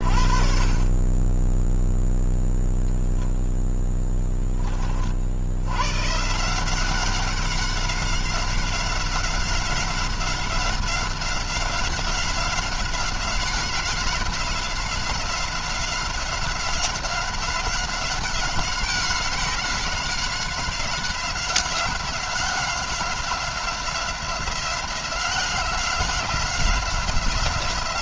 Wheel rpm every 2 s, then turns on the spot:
30, 0, 30, 180, 190, 190, 190, 190, 190, 190, 190, 190, 180, 180.
none